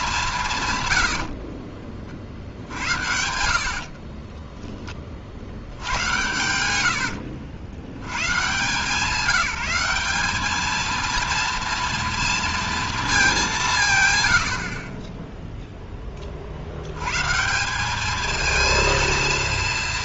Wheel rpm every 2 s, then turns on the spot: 150, 60, 10, 90, 150, 210, 230, 70, 60, 220.
4-8